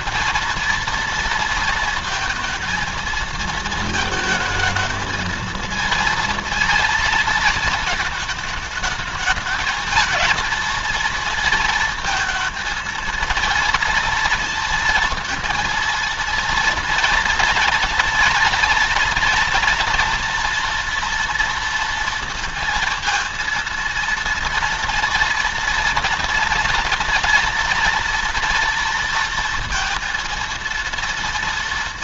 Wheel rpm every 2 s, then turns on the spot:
230, 230, 220, 230, 220, 230, 230, 240, 230, 230, 230, 230, 230, 230, 230, 230.
none